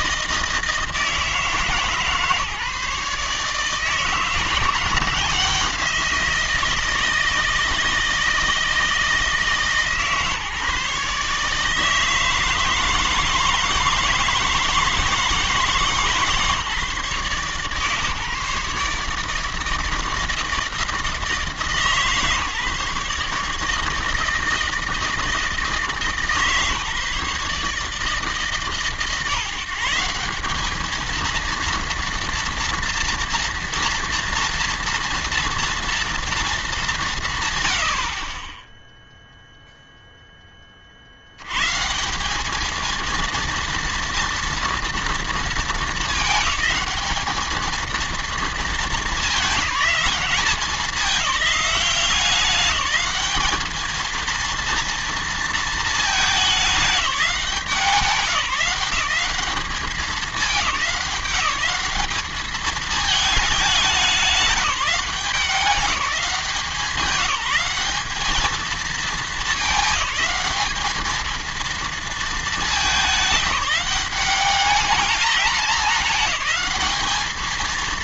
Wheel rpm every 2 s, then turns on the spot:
160, 150, 170, 170, 160, 150, 160, 160, 150, 150, 160, 150, 160, 150, 140, 200, 230, 230, 210, 20, 20, 200, 230, 210, 220, 200, 190, 230, 210, 180, 200, 210, 200, 180, 210, 210, 210, 190, 210.
none